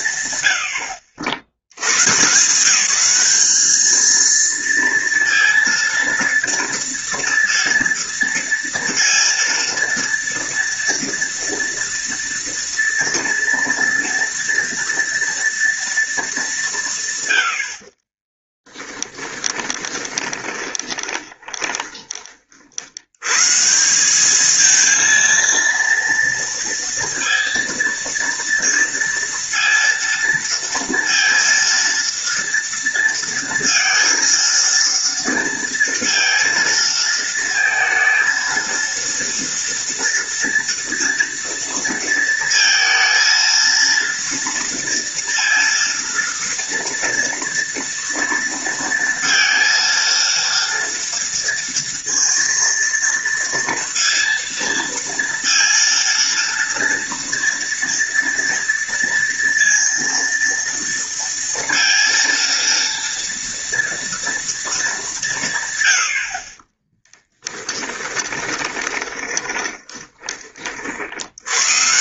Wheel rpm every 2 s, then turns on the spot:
70, 200, 230, 230, 230, 230, 230, 230, 120, 10, 20, 110, 230, 230, 230, 230, 230, 230, 220, 230, 230, 230, 230, 230, 230, 230, 230, 230, 230, 230, 230, 230, 170, 20, 20, 90.
18-22 66-70